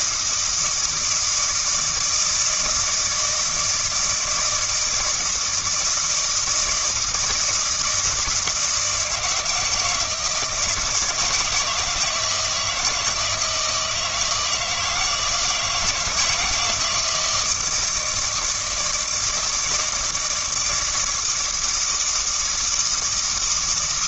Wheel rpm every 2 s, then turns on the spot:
160, 160, 160, 160, 170, 160, 160, 160, 160, 160, 160, 160.
none